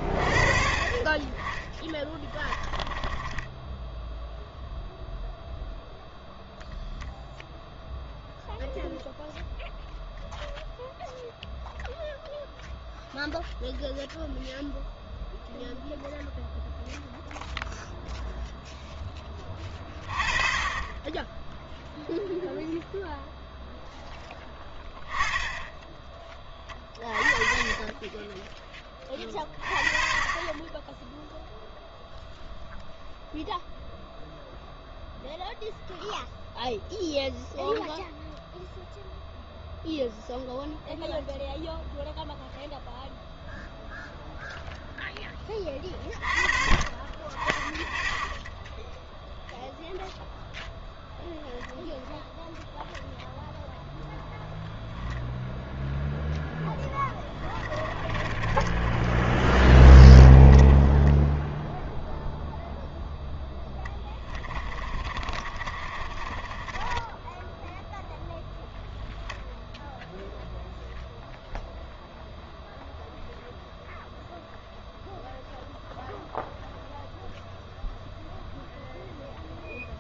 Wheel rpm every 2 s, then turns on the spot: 40, 20, 0, 0, 0, 0, 0, 0, 0, 0, 30, 0, 10, 20, 10, 20, 0, 0, 0, 0, 0, 0, 0, 30, 10, 0, 0, 0, 10, 30, 10, 0, 20, 20, 10, 0, 0, 0, 0, 0.
2-4 48-50 58-62 64-68